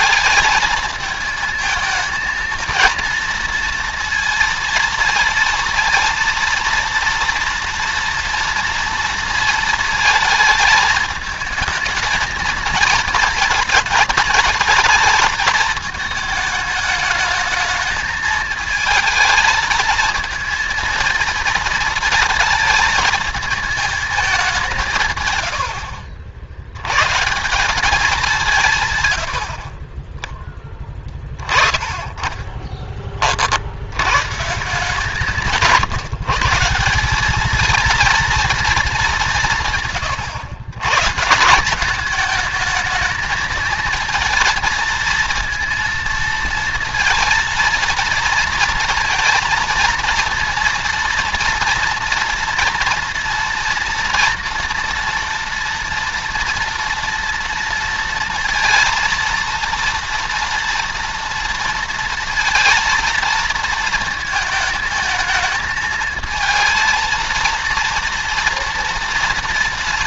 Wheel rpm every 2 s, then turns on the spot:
220, 230, 230, 230, 230, 220, 220, 220, 210, 230, 230, 220, 120, 130, 110, 30, 40, 160, 200, 180, 130, 220, 230, 230, 230, 230, 230, 230, 230, 230, 230, 230, 220, 230, 230.
none